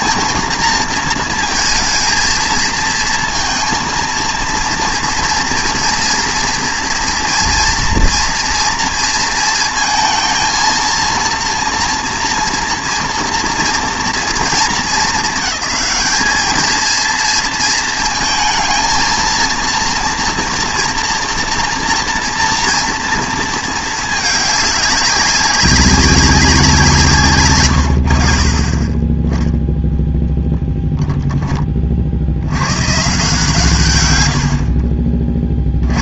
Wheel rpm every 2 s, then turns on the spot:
230, 230, 230, 230, 230, 230, 230, 200, 220, 230, 230, 230, 200, 180, 30, 10, 120, 60.
none